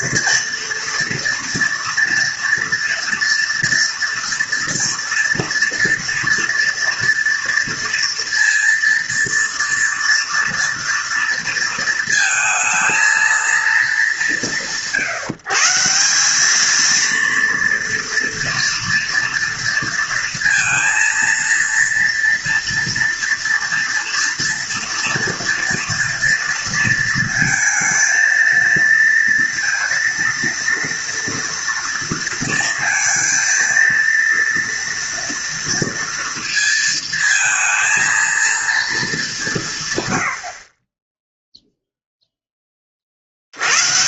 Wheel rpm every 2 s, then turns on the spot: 230, 230, 240, 240, 230, 230, 230, 150, 220, 230, 230, 230, 230, 230, 230, 230, 230, 230, 220, 230, 40, 20.
none